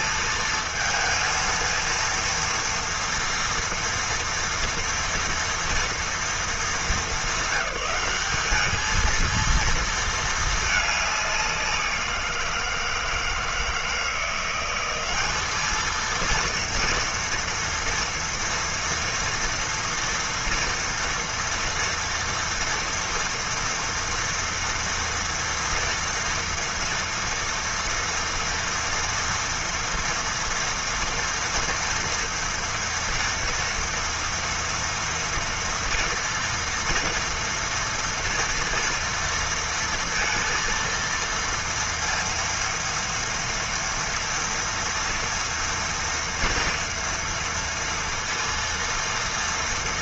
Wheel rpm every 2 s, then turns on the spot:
230, 230, 230, 230, 210, 210, 170, 180, 230, 230, 230, 230, 230, 230, 230, 230, 230, 230, 240, 230, 230, 230, 230, 230, 230.
none